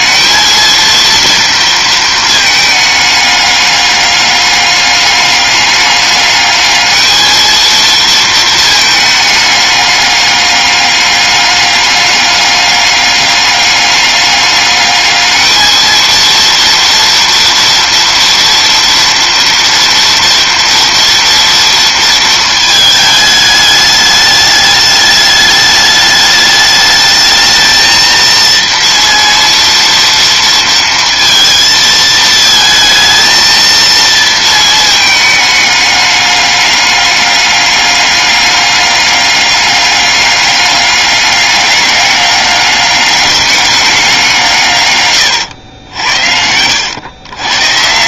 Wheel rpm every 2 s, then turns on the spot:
230, 210, 200, 220, 220, 200, 210, 210, 230, 230, 230, 220, 210, 210, 230, 230, 220, 220, 200, 200, 200, 200, 140, 90.
none